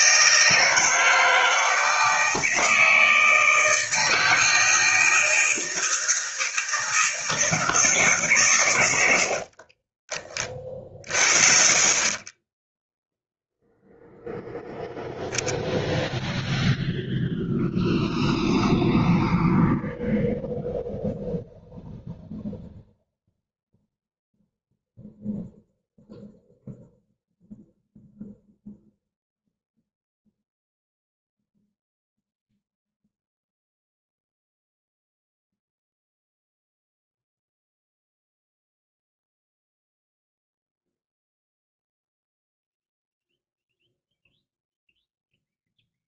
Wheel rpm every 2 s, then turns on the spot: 160, 160, 160, 160, 90, 40, 0, 0, 0, 0, 0, 0, 0, 0, 0, 0, 0, 0, 0, 0, 0, 0, 0.
none